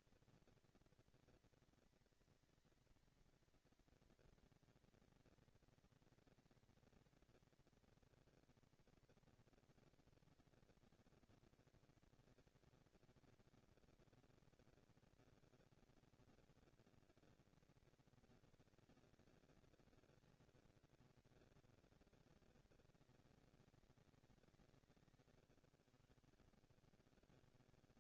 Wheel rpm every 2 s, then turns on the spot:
230, 230, 230, 230, 230, 230, 230, 230, 230, 220, 230, 210, 180, 90.
none